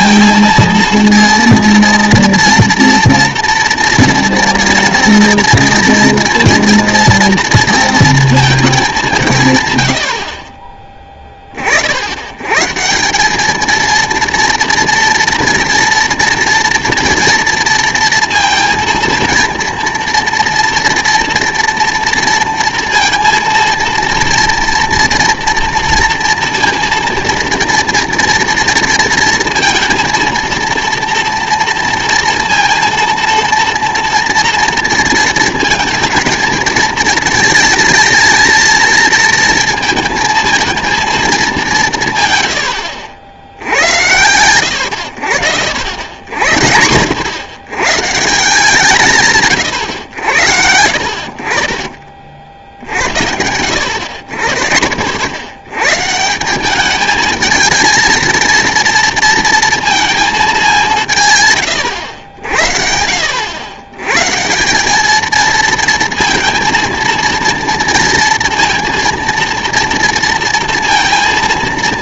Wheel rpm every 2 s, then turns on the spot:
230, 230, 230, 240, 210, 30, 150, 230, 230, 230, 230, 230, 230, 230, 230, 230, 230, 230, 230, 230, 230, 100, 110, 70, 160, 70, 60, 70, 200, 230, 200, 60, 180, 220, 230, 230.
10-12